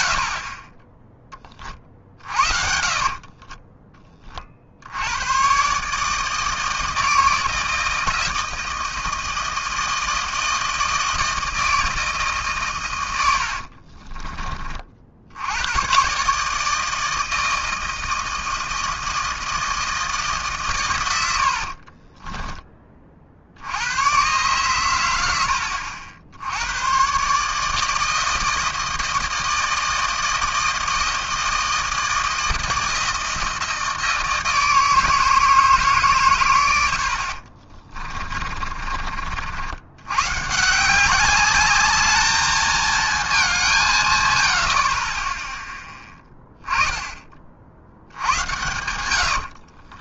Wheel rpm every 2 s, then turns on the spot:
40, 40, 60, 160, 160, 160, 140, 30, 150, 160, 150, 20, 120, 90, 160, 160, 160, 160, 110, 40, 150, 220, 80, 10, 100.
2-4 38-40 48-50